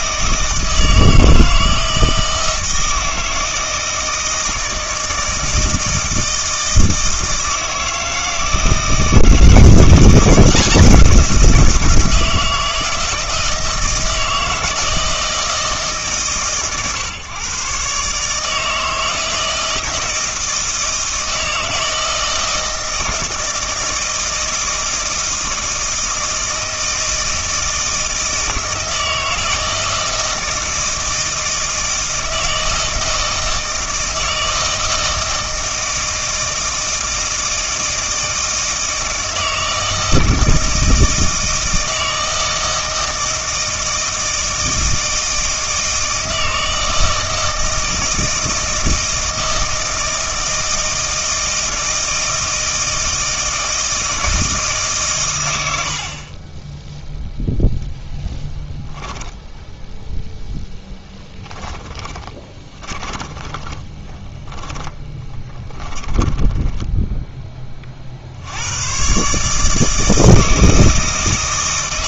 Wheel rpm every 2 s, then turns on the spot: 160, 160, 160, 160, 160, 170, 160, 160, 120, 160, 160, 160, 160, 160, 160, 160, 160, 160, 160, 160, 160, 160, 160, 160, 160, 160, 160, 150, 10, 10, 10, 30, 10, 10, 120, 160.
56-58 60-68